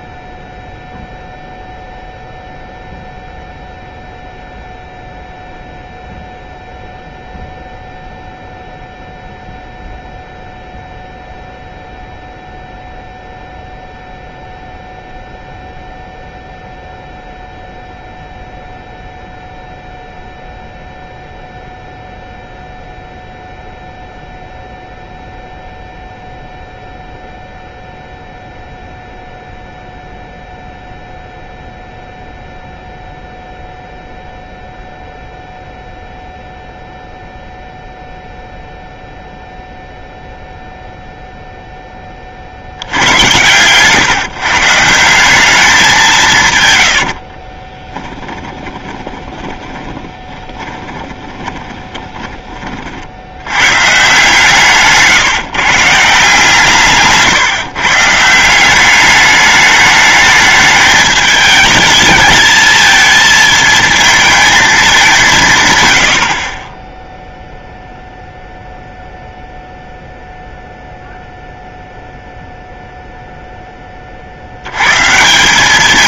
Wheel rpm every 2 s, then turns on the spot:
0, 0, 0, 0, 0, 0, 0, 0, 0, 0, 0, 0, 0, 0, 0, 0, 0, 0, 0, 0, 0, 60, 160, 110, 20, 20, 40, 160, 160, 180, 210, 220, 220, 30, 0, 0, 0, 90.
46-52 54-56